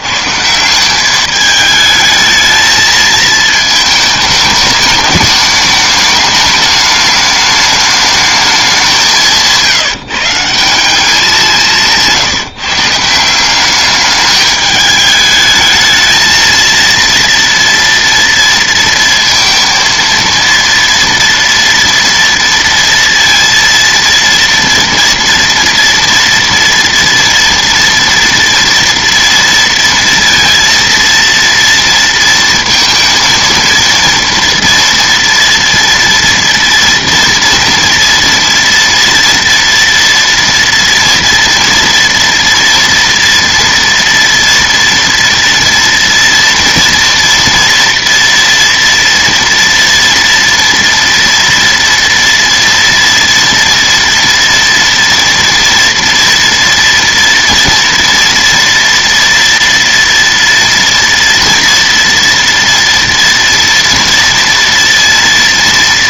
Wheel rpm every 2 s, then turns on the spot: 170, 220, 210, 210, 200, 160, 170, 210, 220, 230, 230, 230, 230, 230, 240, 230, 230, 230, 230, 230, 230, 230, 230, 230, 230, 230, 230, 230, 240, 240, 230, 230, 230.
none